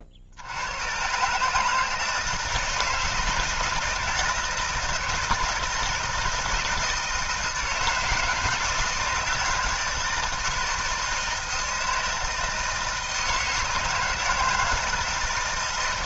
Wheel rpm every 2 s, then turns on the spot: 110, 160, 160, 160, 160, 160, 160, 160.
none